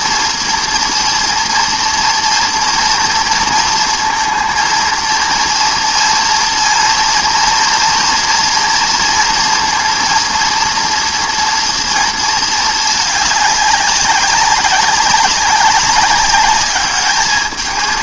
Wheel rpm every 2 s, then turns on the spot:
240, 230, 230, 230, 230, 230, 220, 200, 200.
none